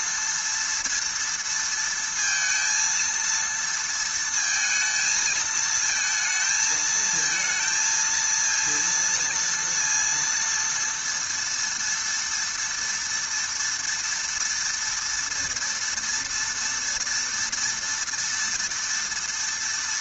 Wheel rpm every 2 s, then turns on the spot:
230, 230, 220, 220, 230, 230, 230, 230, 230, 230.
none